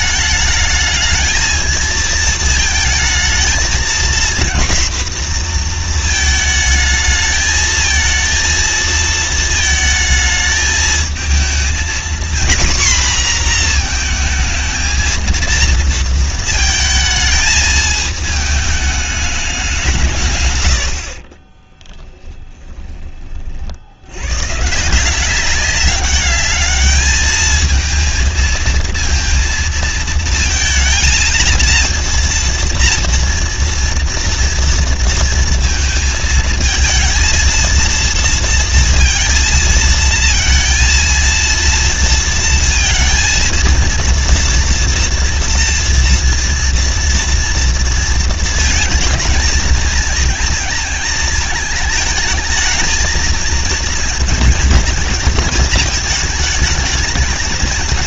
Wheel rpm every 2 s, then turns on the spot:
220, 220, 240, 220, 230, 220, 250, 220, 220, 210, 60, 30, 180, 220, 230, 230, 230, 230, 230, 230, 230, 230, 230, 230, 230, 230, 220, 220, 200.
none